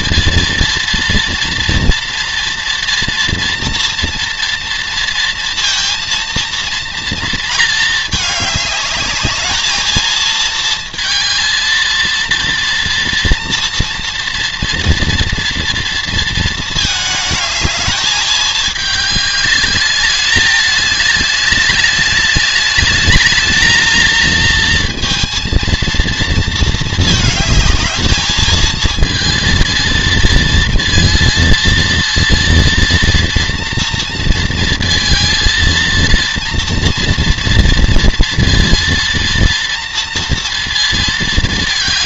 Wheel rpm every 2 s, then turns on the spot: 230, 230, 230, 230, 210, 230, 230, 230, 220, 210, 200, 200, 230, 220, 220, 230, 230, 230, 230, 230, 230.
none